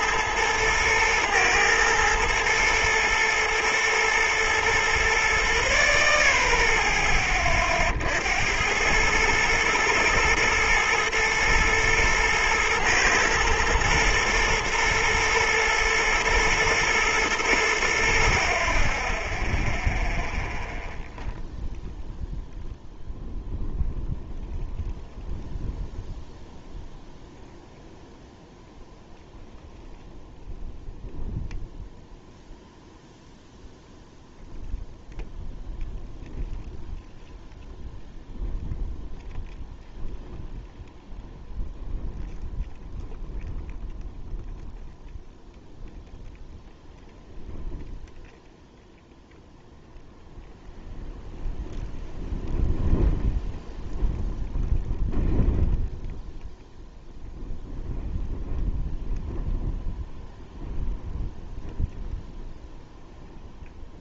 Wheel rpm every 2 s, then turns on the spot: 110, 120, 120, 30, 100, 110, 110, 110, 110, 20, 0, 0, 0, 0, 0, 0, 0, 0, 0, 0, 0, 0, 0, 0, 0, 0, 0, 0, 0, 0, 0, 0.
none